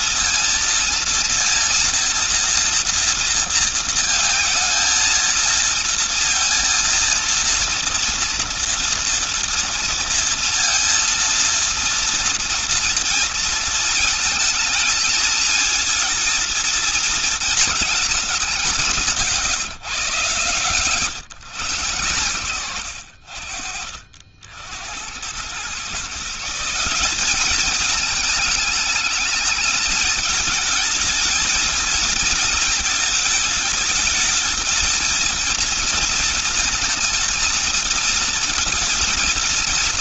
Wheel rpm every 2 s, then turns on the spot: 230, 230, 230, 230, 230, 230, 230, 220, 230, 190, 140, 90, 60, 170, 220, 220, 220, 220, 230, 230.
20-22